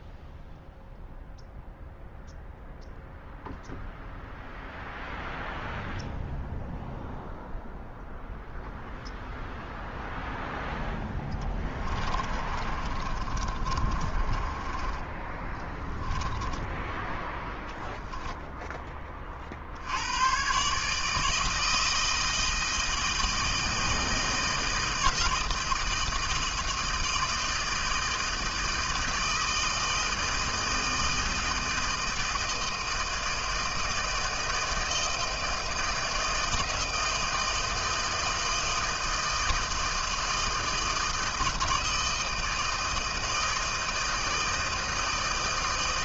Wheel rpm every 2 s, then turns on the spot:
0, 0, 0, 0, 0, 0, 30, 20, 10, 10, 130, 160, 160, 160, 160, 160, 160, 160, 160, 160, 160, 160, 160.
12-18